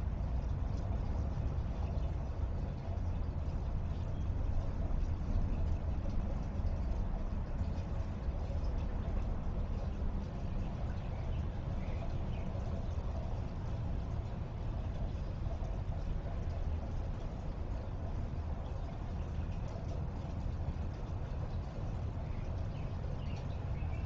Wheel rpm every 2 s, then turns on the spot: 0, 0, 0, 0, 0, 0, 0, 0, 0, 0, 0, 0.
none